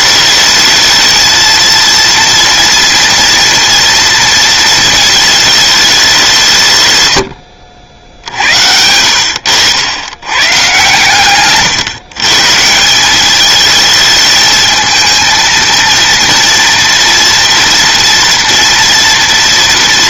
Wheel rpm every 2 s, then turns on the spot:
210, 230, 230, 220, 90, 90, 130, 210, 230, 230.
8-10